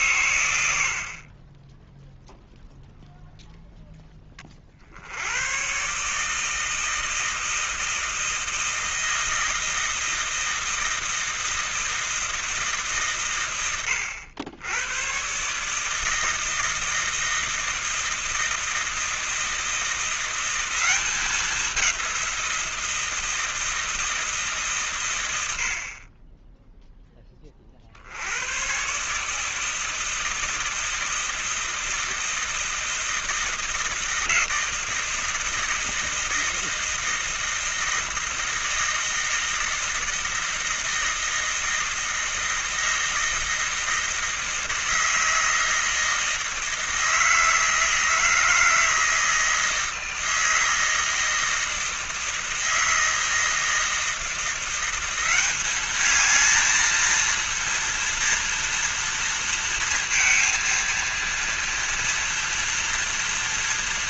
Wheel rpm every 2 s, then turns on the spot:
50, 0, 70, 160, 160, 160, 140, 110, 160, 160, 190, 170, 120, 10, 130, 160, 160, 160, 160, 160, 160, 160, 160, 160, 160, 160, 160, 180, 230, 230, 230, 230.
none